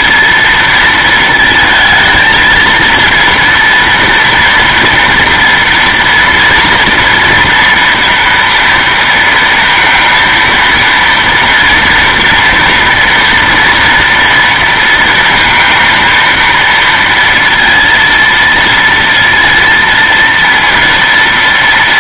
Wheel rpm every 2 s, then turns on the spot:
230, 230, 240, 230, 230, 230, 230, 230, 230, 230, 230.
none